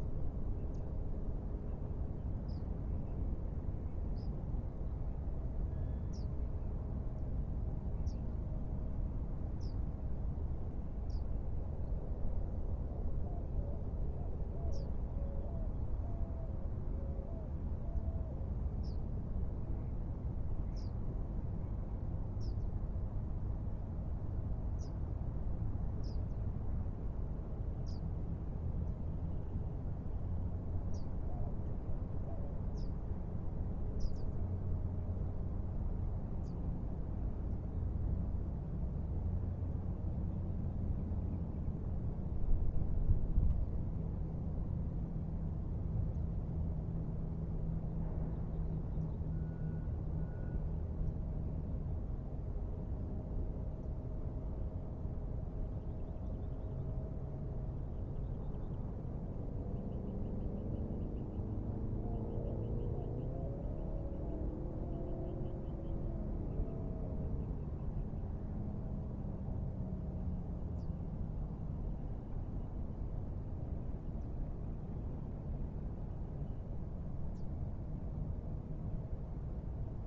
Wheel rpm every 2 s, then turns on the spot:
0, 0, 0, 0, 0, 0, 0, 0, 0, 0, 0, 0, 0, 0, 0, 0, 0, 0, 0, 0, 0, 0, 0, 0, 0, 0, 0, 0, 0, 0, 0, 0, 0, 0, 0, 0, 0, 0, 0, 0.
none